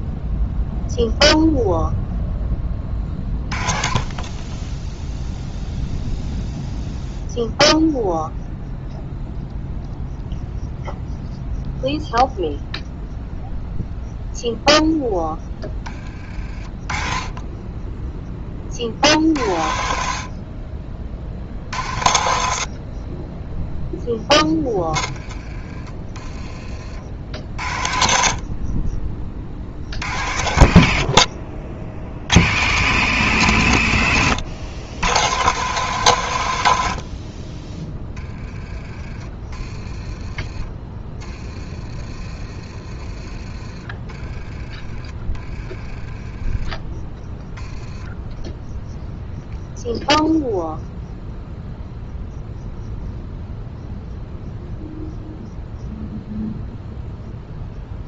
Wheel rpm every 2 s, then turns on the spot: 0, 20, 20, 0, 0, 0, 0, 0, 40, 40, 40, 30, 10, 40, 40, 60, 90, 90, 80, 20, 20, 30, 30, 10, 0, 0, 0, 0, 0.
44-46